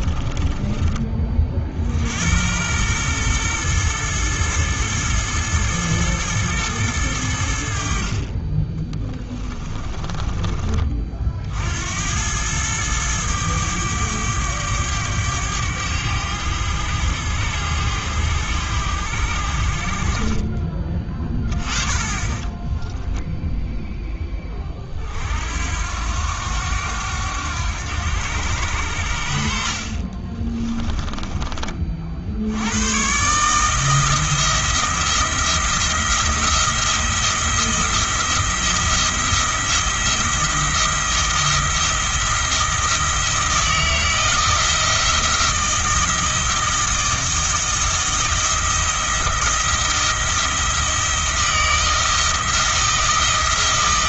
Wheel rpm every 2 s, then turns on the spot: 20, 110, 110, 110, 20, 30, 110, 100, 100, 90, 20, 10, 30, 90, 80, 20, 100, 170, 170, 170, 170, 160, 170, 170, 170, 170, 160.
0-2 8-10 22-24 30-32